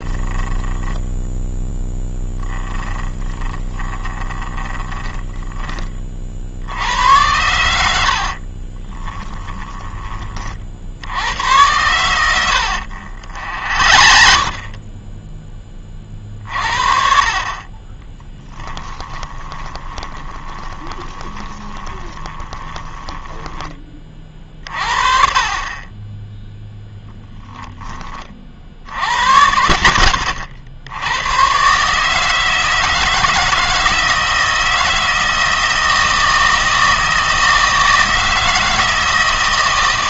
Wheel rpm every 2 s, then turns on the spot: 10, 10, 20, 70, 40, 60, 80, 20, 50, 20, 20, 10, 40, 20, 70, 80, 160, 160, 160, 160.
0-6 8-10 12-14 18-24 26-28